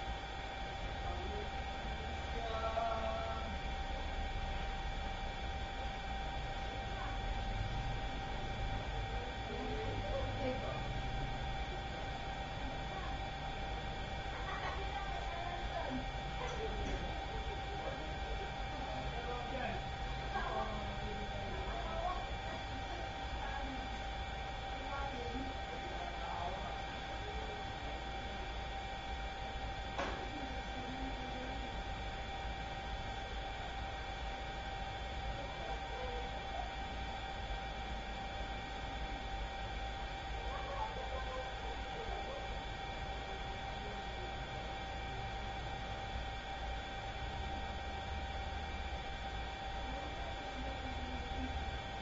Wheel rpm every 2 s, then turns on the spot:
0, 0, 0, 0, 0, 0, 0, 0, 0, 0, 0, 0, 0, 0, 0, 0, 0, 0, 0, 0, 0, 0, 0, 0, 0, 0.
none